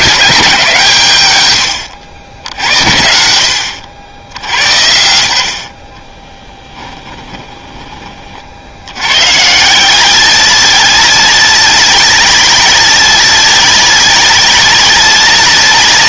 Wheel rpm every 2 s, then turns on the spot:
150, 80, 80, 10, 90, 190, 190, 190.
6-8